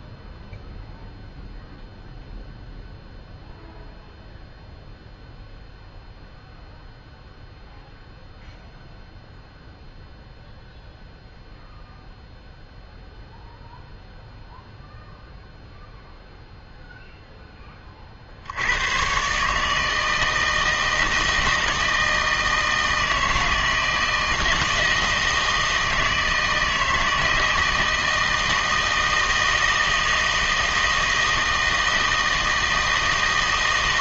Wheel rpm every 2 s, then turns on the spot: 0, 0, 0, 0, 0, 0, 0, 0, 0, 80, 160, 160, 170, 160, 160, 160, 160.
none